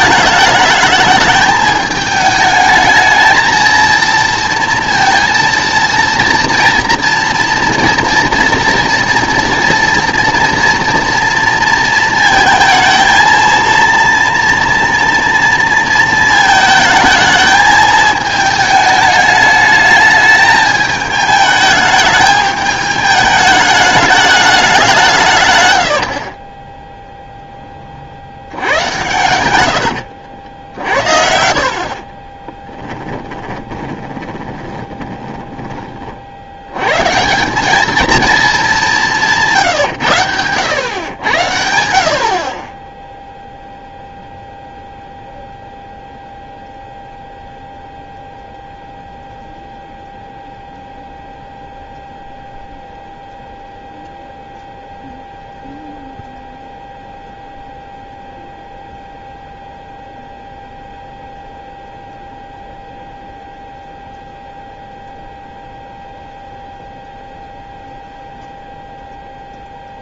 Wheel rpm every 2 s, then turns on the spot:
210, 210, 230, 230, 230, 240, 220, 230, 220, 220, 220, 210, 190, 20, 100, 70, 10, 20, 100, 210, 110, 20, 0, 0, 0, 0, 0, 0, 0, 0, 0, 0, 0, 0, 0.
26-30 32-36